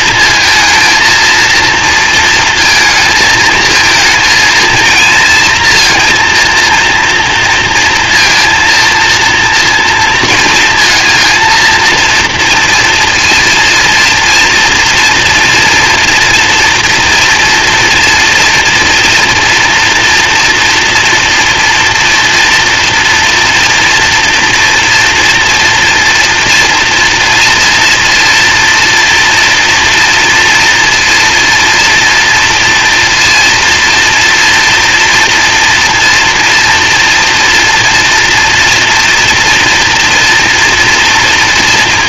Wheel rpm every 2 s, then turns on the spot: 230, 230, 230, 230, 220, 220, 230, 230, 230, 240, 230, 230, 230, 230, 230, 230, 230, 230, 230, 230, 240.
none